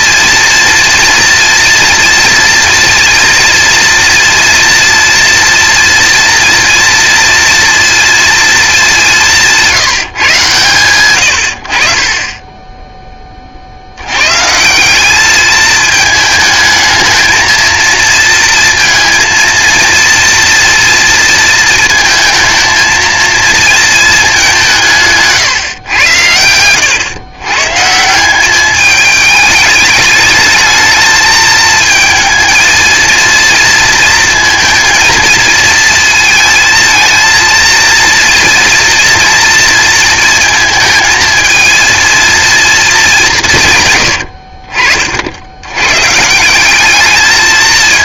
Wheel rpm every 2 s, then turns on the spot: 230, 230, 230, 230, 220, 140, 20, 160, 220, 230, 230, 220, 200, 100, 200, 210, 220, 230, 220, 240, 220, 230, 70, 180.
44-46